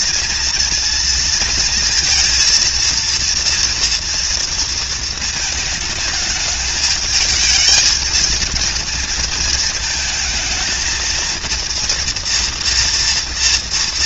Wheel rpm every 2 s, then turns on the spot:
230, 230, 230, 220, 220, 220, 230.
none